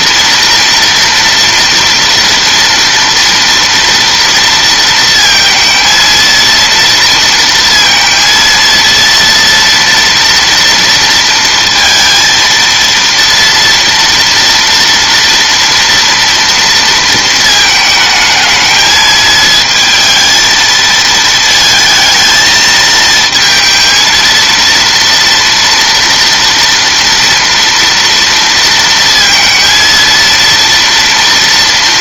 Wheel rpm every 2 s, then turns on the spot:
230, 230, 230, 230, 230, 230, 230, 230, 230, 220, 220, 220, 230, 230, 230, 230.
none